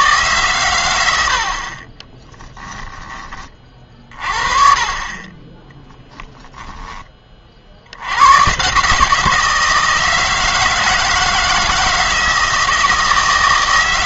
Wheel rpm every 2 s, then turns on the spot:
110, 10, 30, 20, 130, 160, 160.
none